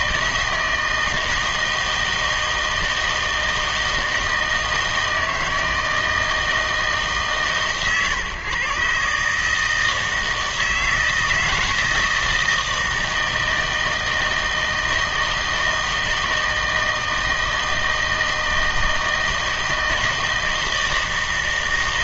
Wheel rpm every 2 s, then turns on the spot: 160, 160, 160, 160, 130, 160, 160, 160, 160, 160, 160.
none